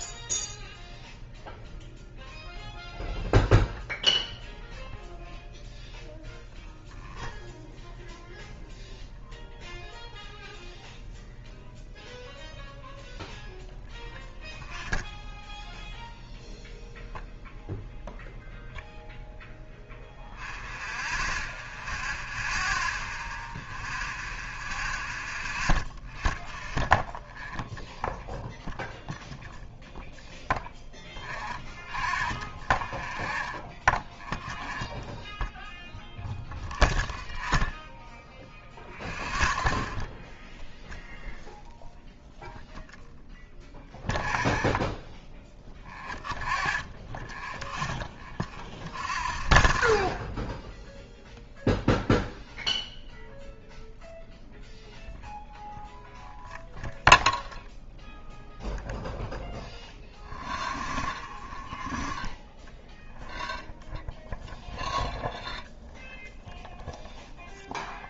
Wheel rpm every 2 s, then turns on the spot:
0, 0, 0, 0, 0, 0, 0, 0, 0, 0, 0, 0, 0, 0, 0, 0, 0, 0, 0, 0, 0, 0, 0, 0, 0, 0, 0, 0, 0, 0, 0, 0, 0, 0.
none